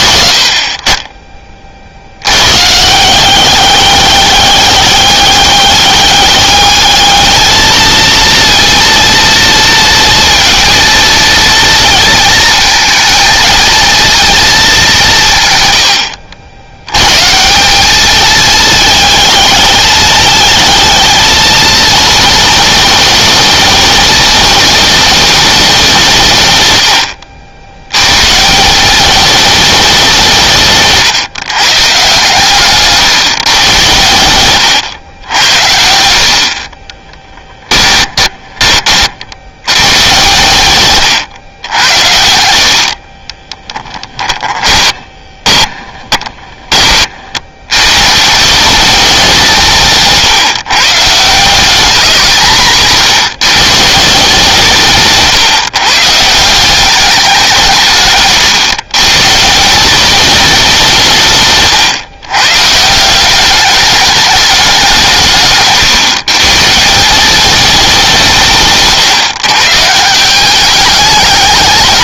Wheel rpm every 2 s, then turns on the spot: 30, 170, 200, 210, 230, 230, 230, 190, 100, 220, 220, 230, 220, 100, 200, 150, 150, 110, 20, 50, 130, 50, 20, 40, 190, 150, 150, 150, 190, 140, 180, 180, 190, 180, 150, 210.
30-32 36-38 42-46 52-54